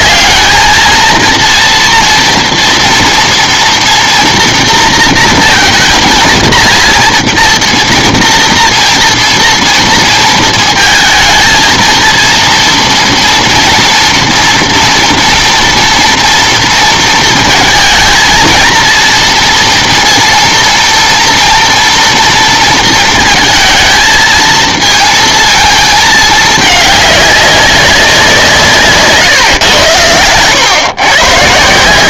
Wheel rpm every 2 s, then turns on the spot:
220, 230, 230, 230, 230, 230, 230, 240, 230, 220, 230, 230, 220, 210, 170, 120.
none